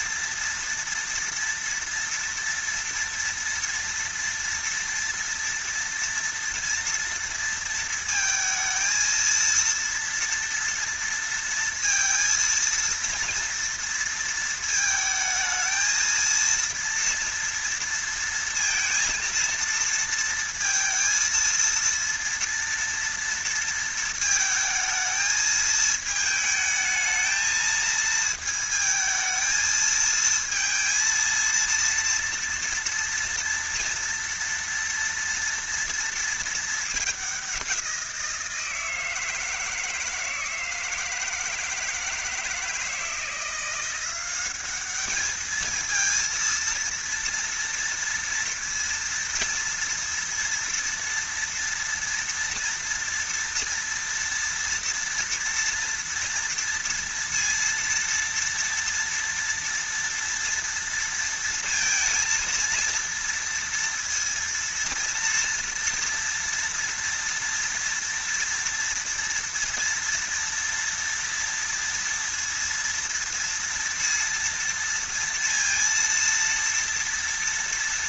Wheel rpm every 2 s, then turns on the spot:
230, 230, 230, 230, 230, 230, 230, 220, 230, 230, 230, 230, 220, 220, 220, 230, 230, 230, 210, 160, 160, 160, 210, 230, 230, 230, 230, 230, 230, 230, 230, 230, 230, 230, 230, 230, 230, 230, 230.
none